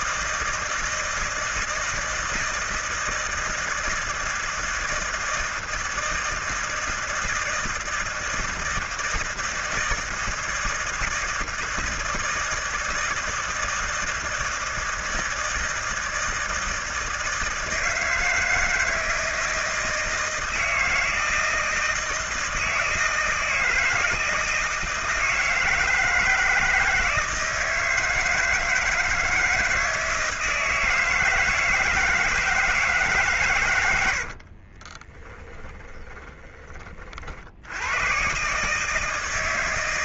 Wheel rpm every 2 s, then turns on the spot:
160, 160, 160, 160, 160, 160, 160, 160, 160, 160, 160, 160, 160, 160, 160, 160, 150, 30, 40, 150.
34-36